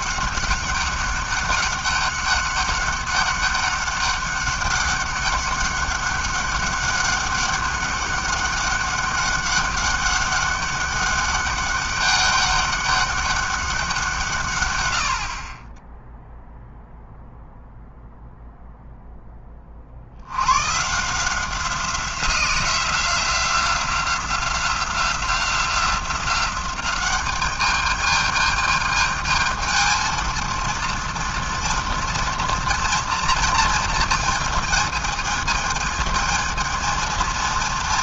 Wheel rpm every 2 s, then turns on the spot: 200, 200, 200, 200, 200, 200, 200, 110, 0, 0, 130, 180, 180, 190, 220, 230, 230, 220, 220.
none